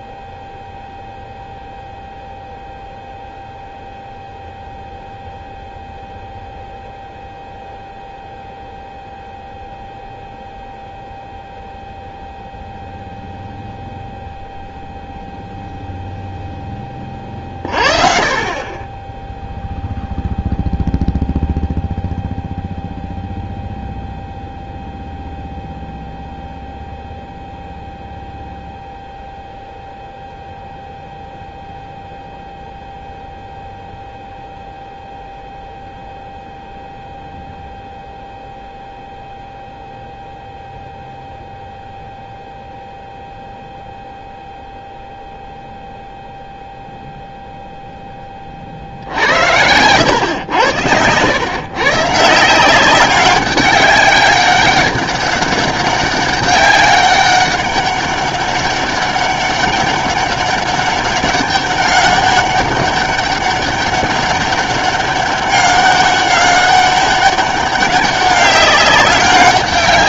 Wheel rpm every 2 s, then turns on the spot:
0, 0, 0, 0, 0, 0, 0, 0, 10, 30, 0, 0, 0, 0, 0, 0, 0, 0, 0, 0, 0, 0, 0, 0, 40, 90, 180, 200, 200, 200, 200, 200, 200, 200, 190.
none